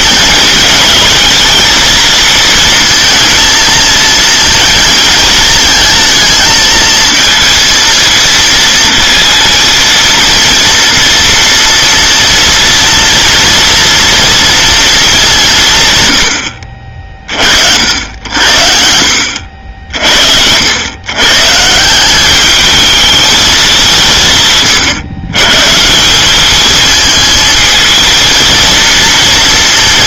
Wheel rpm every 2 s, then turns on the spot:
220, 230, 230, 220, 230, 230, 230, 230, 60, 60, 80, 210, 140, 210, 230.
none